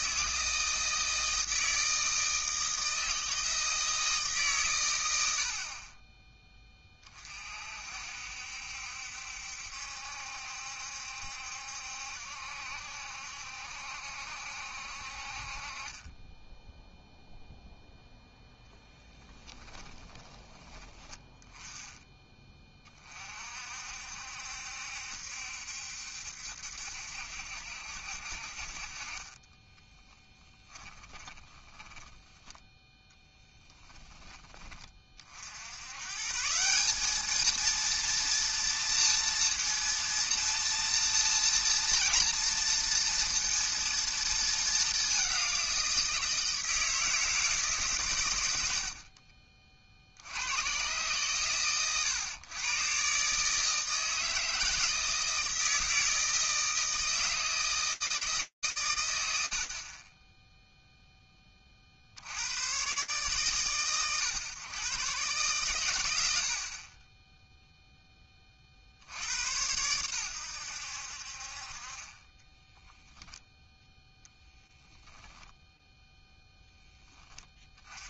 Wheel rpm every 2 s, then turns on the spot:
160, 160, 140, 20, 70, 70, 70, 70, 10, 0, 20, 20, 70, 70, 50, 20, 10, 20, 160, 230, 230, 230, 220, 160, 90, 90, 110, 160, 160, 150, 0, 110, 110, 50, 60, 70, 10, 20, 20.
30-32 66-68 74-76